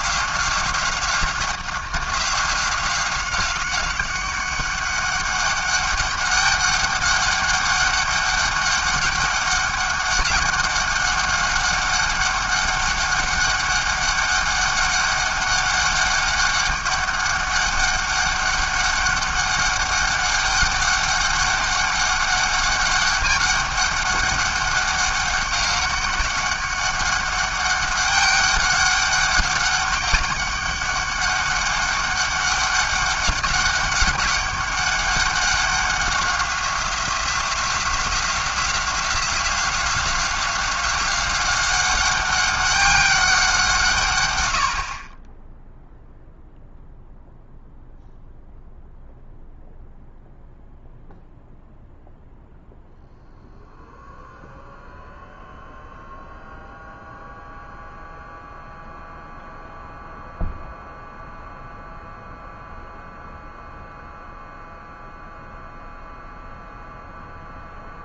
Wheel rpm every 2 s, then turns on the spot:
190, 180, 200, 200, 200, 200, 200, 200, 200, 200, 200, 200, 200, 200, 200, 200, 200, 200, 180, 180, 190, 200, 60, 0, 0, 0, 0, 0, 0, 0, 0, 0, 0, 0.
none